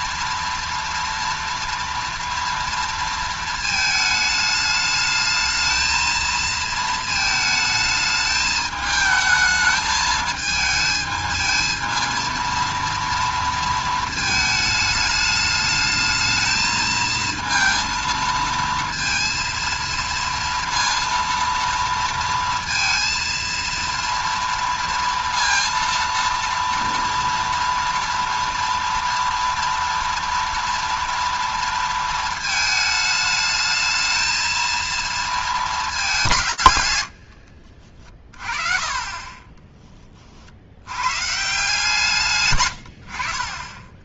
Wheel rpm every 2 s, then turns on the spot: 230, 230, 210, 220, 220, 220, 230, 220, 220, 230, 230, 230, 230, 230, 230, 230, 220, 220, 130, 40, 80, 110.
none